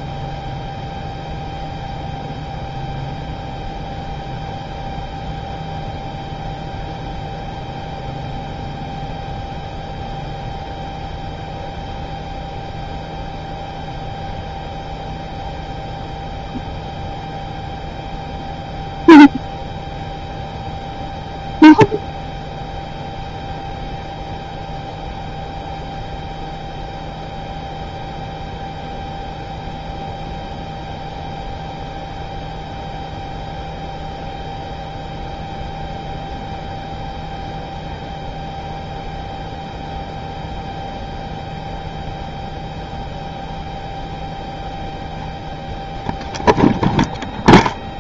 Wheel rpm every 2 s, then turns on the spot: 0, 0, 0, 0, 0, 0, 0, 0, 0, 0, 0, 0, 0, 0, 0, 0, 0, 0, 0, 0, 0, 0, 0, 0.
none